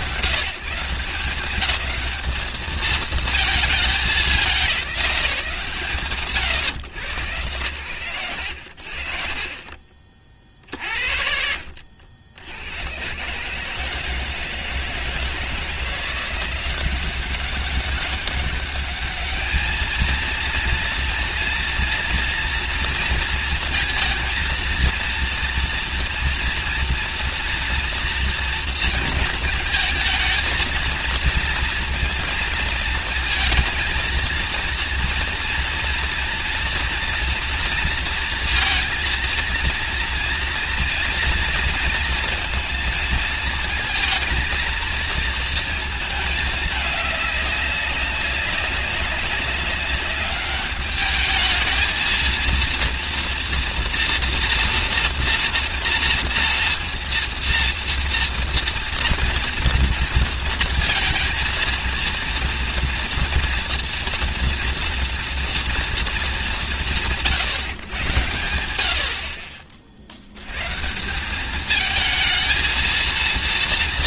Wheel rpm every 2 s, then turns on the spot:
170, 220, 180, 110, 80, 50, 90, 160, 180, 200, 230, 230, 230, 240, 230, 230, 230, 230, 230, 230, 230, 230, 230, 210, 200, 210, 230, 240, 230, 230, 230, 230, 230, 190, 80, 150, 220.
none